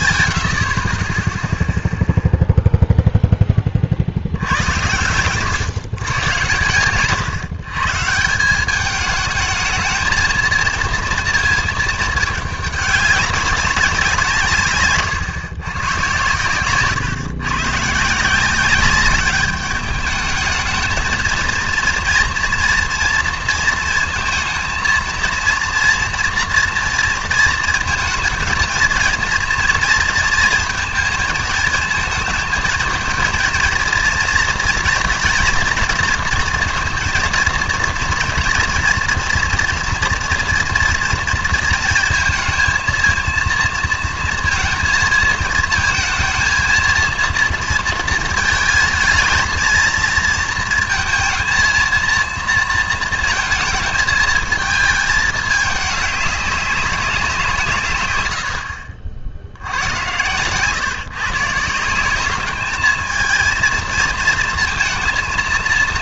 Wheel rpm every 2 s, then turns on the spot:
50, 0, 90, 130, 190, 230, 210, 150, 120, 190, 220, 230, 230, 230, 220, 230, 220, 230, 230, 240, 240, 230, 230, 220, 220, 230, 230, 220, 200, 70, 120, 210, 230.
none